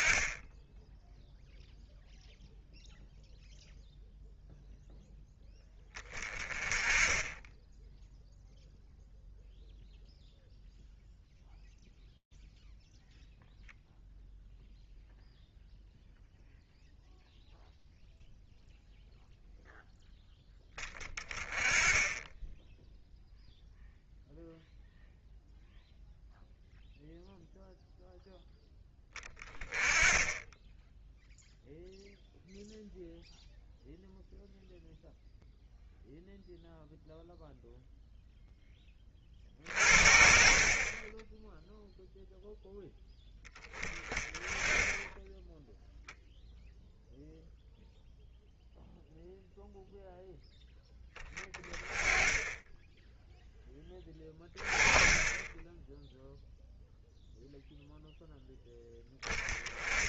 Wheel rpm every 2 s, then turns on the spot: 10, 0, 10, 20, 0, 0, 0, 0, 0, 0, 10, 0, 0, 0, 10, 0, 0, 0, 0, 20, 40, 0, 10, 0, 0, 10, 10, 20, 0, 20.
40-42